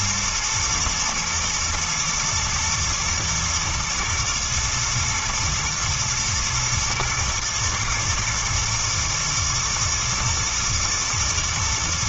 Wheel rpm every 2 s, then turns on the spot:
110, 110, 110, 110, 120, 120.
none